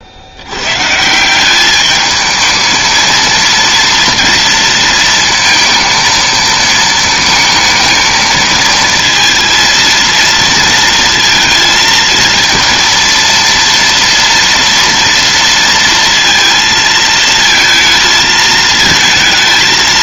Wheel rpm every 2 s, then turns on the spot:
100, 220, 230, 220, 220, 230, 230, 230, 230, 220.
none